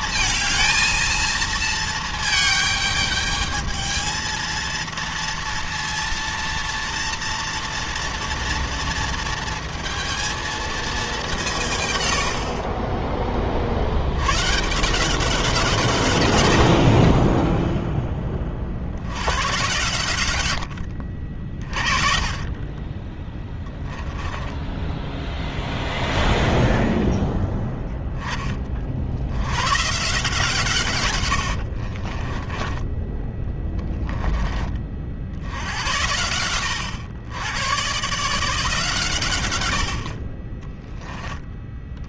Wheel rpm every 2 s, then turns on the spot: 230, 220, 230, 230, 230, 230, 80, 90, 130, 10, 110, 30, 10, 10, 10, 130, 50, 10, 90, 140, 60.
24-28 32-34